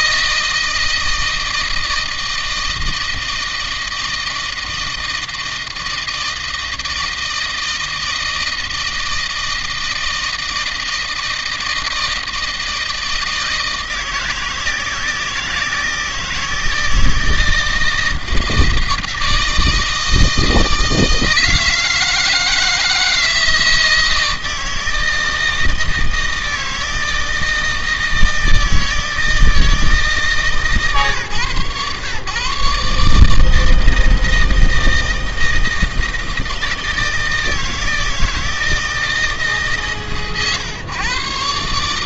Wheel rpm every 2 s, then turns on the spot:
160, 160, 160, 160, 160, 160, 160, 160, 160, 160, 160, 160, 160, 160, 160, 150, 140, 160, 160, 160, 130.
none